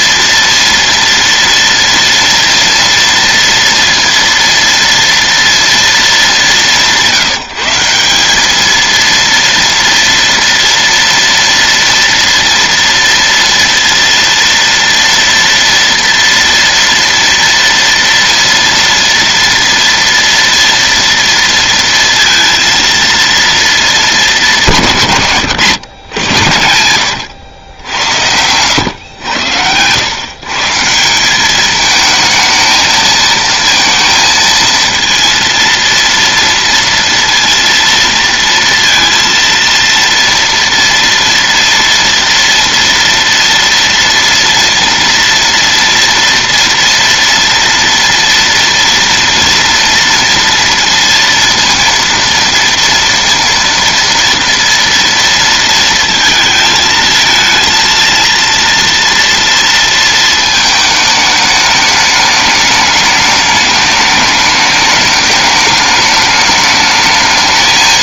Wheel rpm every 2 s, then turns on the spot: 230, 230, 230, 190, 220, 230, 230, 230, 230, 230, 230, 230, 190, 100, 110, 160, 230, 230, 230, 230, 230, 230, 230, 230, 230, 230, 230, 230, 220, 230, 220, 210, 210, 210.
26-28